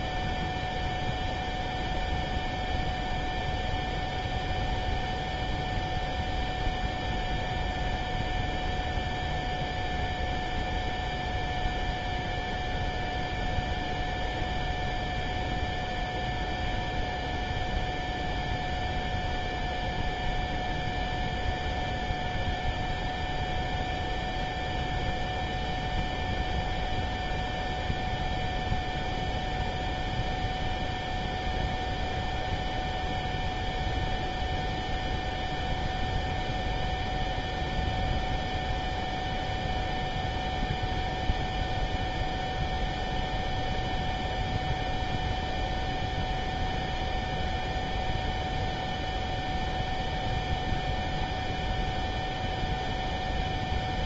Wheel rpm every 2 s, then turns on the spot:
0, 0, 0, 0, 0, 0, 0, 0, 0, 0, 0, 0, 0, 0, 0, 0, 0, 0, 0, 0, 0, 0, 0, 0, 0, 0, 0.
none